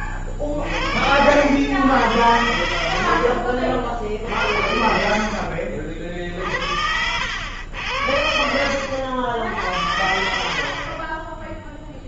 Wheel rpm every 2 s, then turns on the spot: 30, 80, 60, 50, 70, 80.
10-12